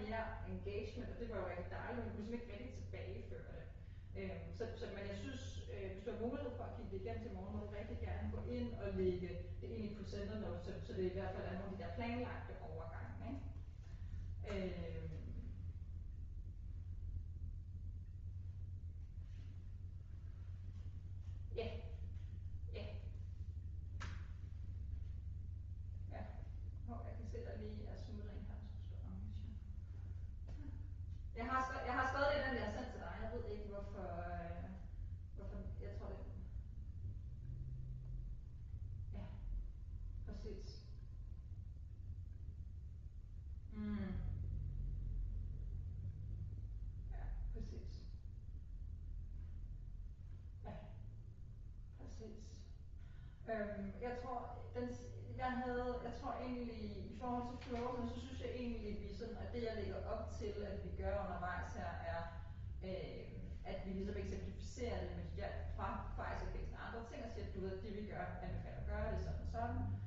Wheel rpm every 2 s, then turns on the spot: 0, 0, 0, 0, 0, 0, 0, 0, 0, 0, 0, 0, 0, 0, 0, 0, 0, 0, 0, 0, 0, 0, 0, 0, 0, 0, 0, 0, 0, 0, 0, 0, 0, 0, 0.
none